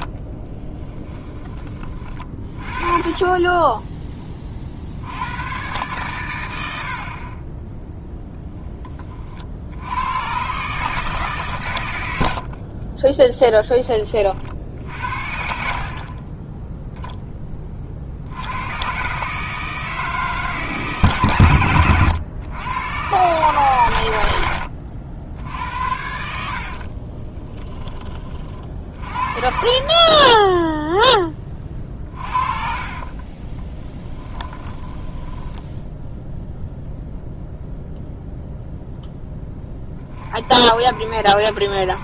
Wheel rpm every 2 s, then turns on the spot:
30, 30, 50, 80, 10, 140, 20, 60, 10, 90, 150, 110, 80, 60, 40, 10, 40, 20, 0, 0, 50.
0-2 12-18 24-28 32-36